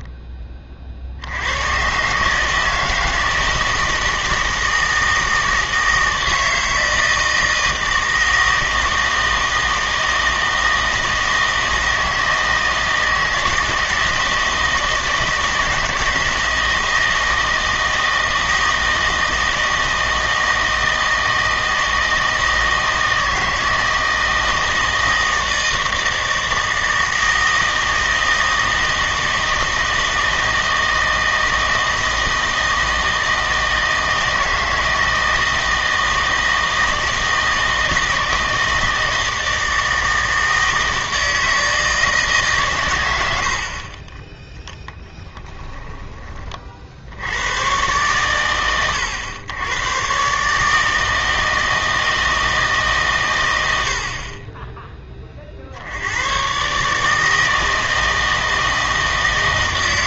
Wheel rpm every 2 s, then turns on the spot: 40, 160, 160, 160, 160, 160, 160, 170, 160, 160, 160, 160, 160, 160, 160, 160, 160, 160, 160, 160, 160, 130, 10, 40, 100, 150, 160, 20, 130, 160.
none